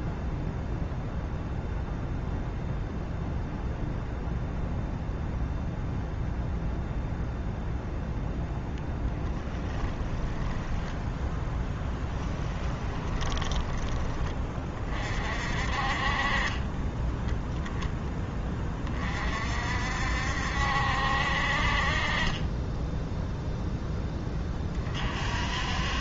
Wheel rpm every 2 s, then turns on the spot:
0, 0, 0, 0, 10, 10, 20, 30, 20, 30, 70, 10, 40.
10-14 16-18